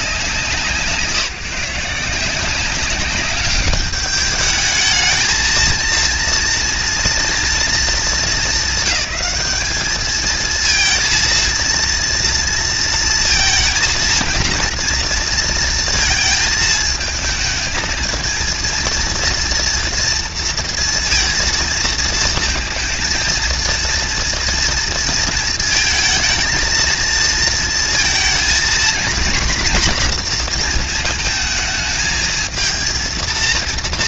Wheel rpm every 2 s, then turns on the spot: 170, 190, 210, 230, 210, 230, 230, 230, 220, 230, 230, 230, 230, 220, 230, 230, 230.
none